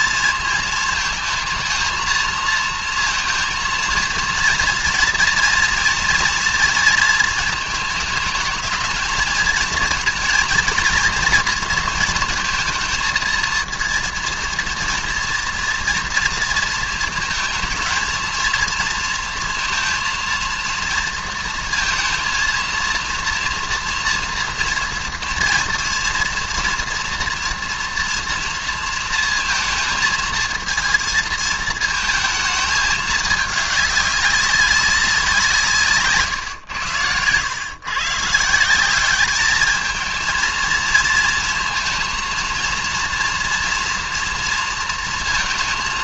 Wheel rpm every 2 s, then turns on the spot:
220, 230, 230, 230, 220, 230, 230, 230, 230, 230, 230, 230, 230, 240, 230, 230, 220, 200, 110, 180, 230, 230, 230.
none